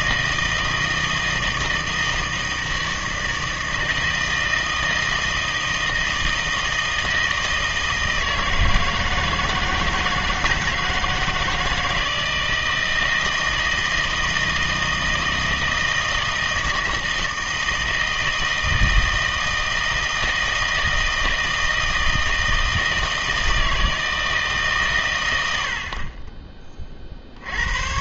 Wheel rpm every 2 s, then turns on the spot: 160, 160, 160, 160, 160, 160, 160, 160, 160, 160, 160, 160, 150, 30.
none